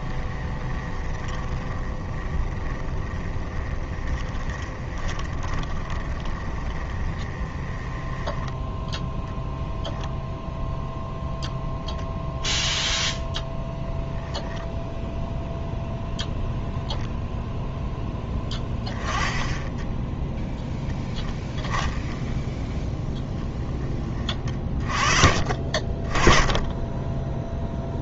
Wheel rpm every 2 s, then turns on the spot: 20, 20, 20, 20, 10, 0, 0, 0, 0, 20, 0, 0, 30, 20.
0-8